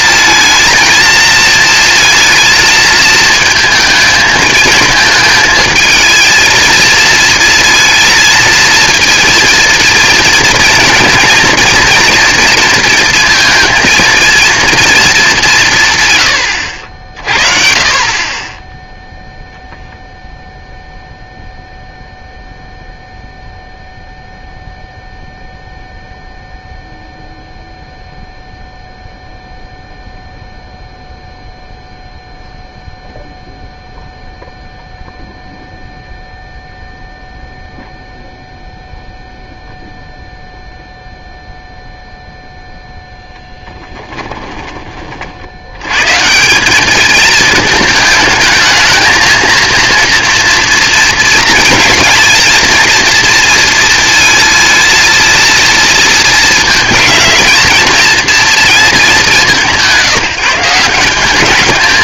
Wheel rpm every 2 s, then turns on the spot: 230, 230, 220, 230, 230, 230, 230, 210, 60, 0, 0, 0, 0, 0, 0, 0, 0, 0, 0, 0, 0, 0, 20, 190, 220, 230, 230, 230, 220, 230, 170.
none